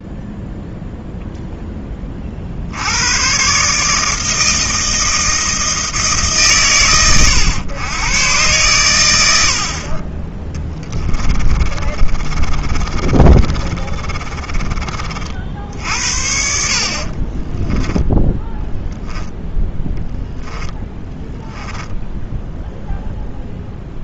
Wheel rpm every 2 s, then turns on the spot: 0, 70, 160, 110, 110, 10, 30, 30, 60, 0, 10, 0.
10-16 20-22